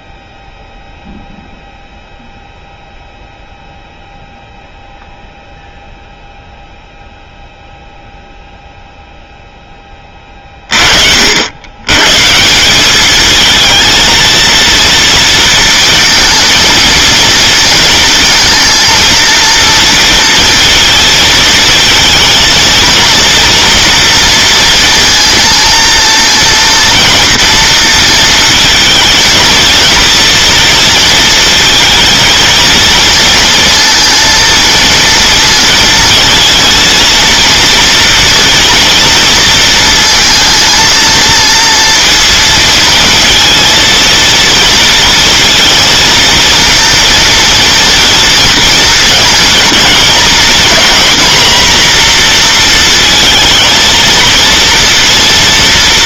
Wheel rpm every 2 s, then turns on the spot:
0, 0, 0, 0, 0, 40, 200, 230, 230, 230, 230, 230, 230, 240, 230, 230, 230, 240, 230, 230, 230, 230, 230, 230, 230, 240, 230, 230.
none